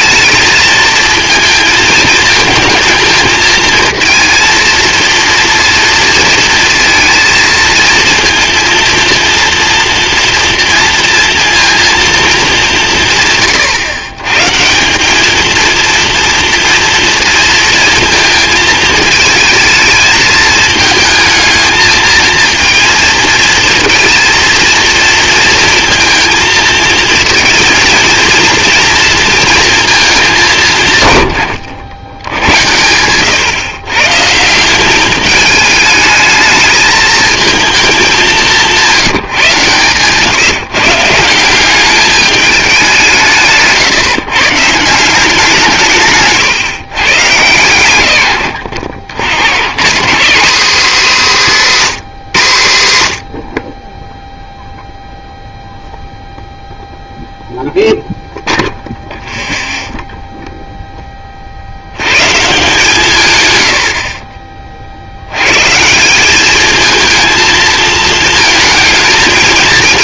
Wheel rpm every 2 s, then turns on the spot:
220, 220, 230, 230, 230, 230, 190, 160, 230, 220, 220, 230, 230, 220, 230, 170, 100, 180, 210, 170, 140, 200, 150, 140, 90, 240, 140, 0, 0, 0, 0, 150, 40, 210, 220.
none